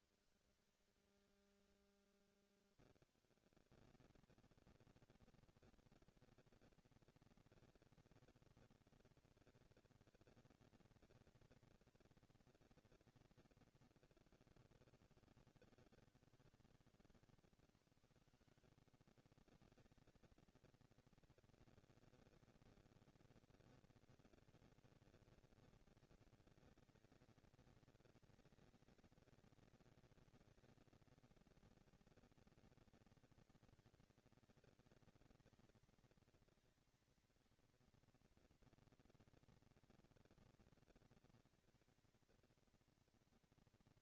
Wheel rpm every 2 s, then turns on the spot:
110, 70, 230, 230, 220, 230, 220, 160, 120, 140, 230, 230, 230, 230, 230, 230, 230, 220, 230, 230, 230, 220.
16-18